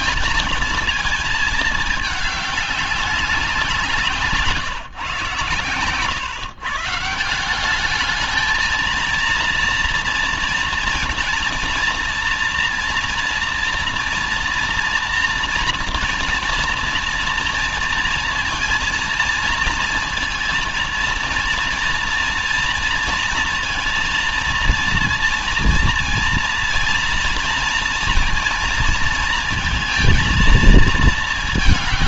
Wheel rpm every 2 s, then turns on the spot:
230, 200, 150, 130, 220, 230, 240, 230, 240, 230, 230, 230, 230, 230, 230, 230.
none